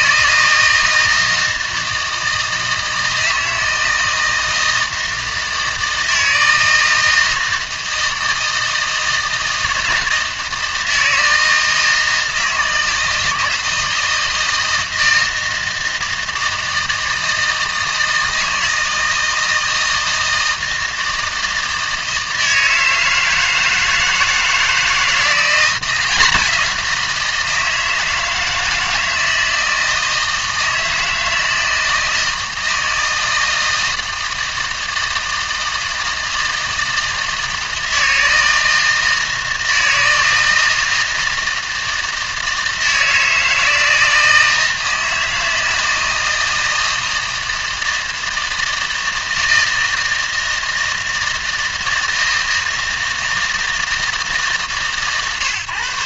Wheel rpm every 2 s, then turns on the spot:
160, 160, 160, 160, 160, 160, 160, 160, 160, 160, 160, 160, 160, 180, 160, 160, 160, 160, 160, 160, 160, 160, 160, 160, 160, 160, 160, 150.
none